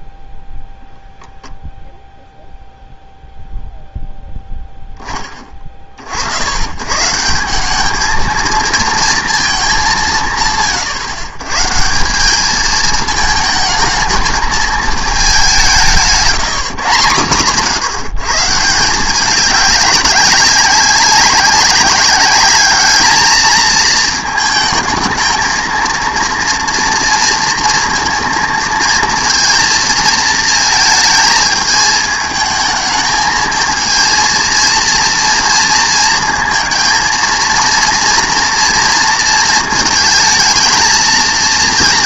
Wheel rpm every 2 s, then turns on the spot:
0, 0, 0, 100, 230, 140, 210, 220, 150, 150, 190, 210, 220, 230, 230, 230, 220, 230, 230, 230, 220.
none